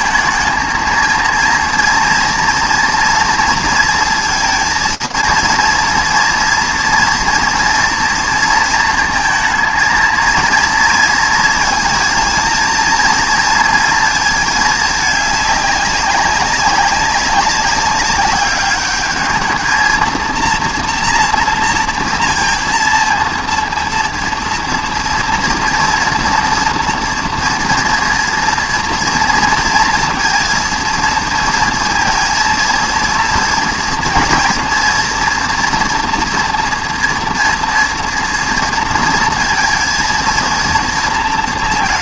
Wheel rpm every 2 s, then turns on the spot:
220, 230, 230, 230, 230, 230, 230, 210, 200, 200, 230, 230, 230, 230, 230, 230, 230, 240, 230, 230, 230.
none